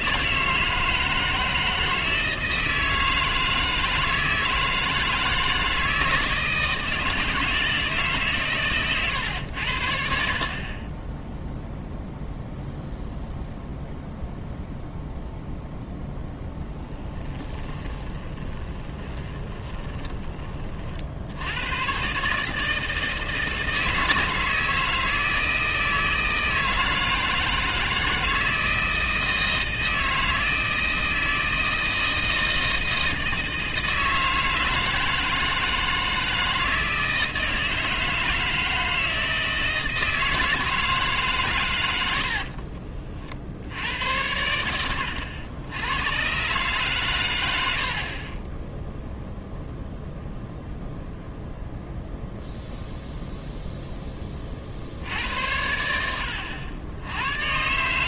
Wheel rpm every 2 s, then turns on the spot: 160, 160, 160, 160, 120, 20, 0, 0, 10, 20, 50, 160, 160, 160, 160, 160, 160, 160, 160, 160, 160, 50, 80, 130, 10, 0, 0, 60, 80.
16-20 42-44